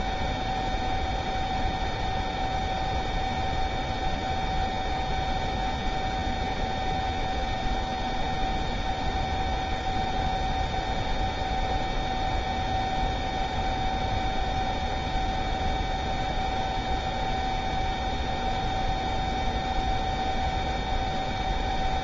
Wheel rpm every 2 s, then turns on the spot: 0, 0, 0, 0, 0, 0, 0, 0, 0, 0, 0.
none